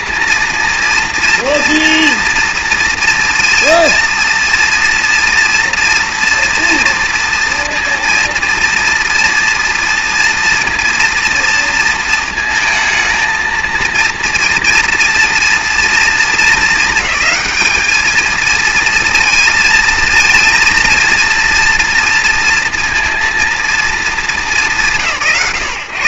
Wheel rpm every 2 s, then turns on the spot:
230, 240, 230, 230, 230, 230, 230, 230, 220, 220, 230, 230, 200.
none